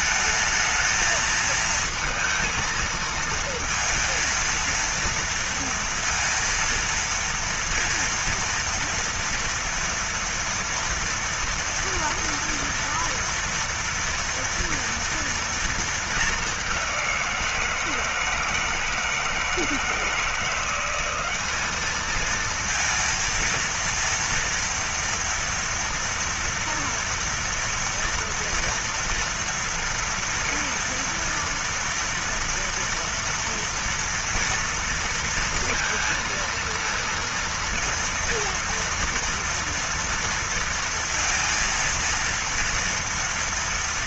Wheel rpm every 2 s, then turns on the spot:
220, 230, 230, 230, 230, 230, 230, 230, 200, 160, 170, 220, 230, 230, 230, 230, 230, 230, 230, 230, 230, 230.
none